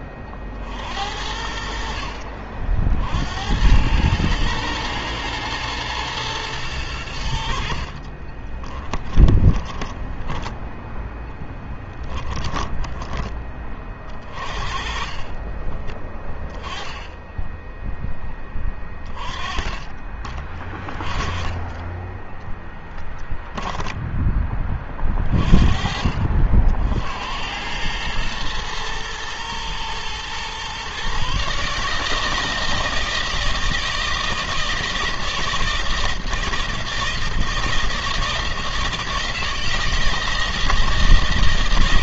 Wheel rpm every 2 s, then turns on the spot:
50, 60, 120, 110, 20, 10, 10, 40, 10, 10, 20, 10, 20, 60, 110, 120, 160, 160, 160, 160, 160.
8-10 12-16 22-24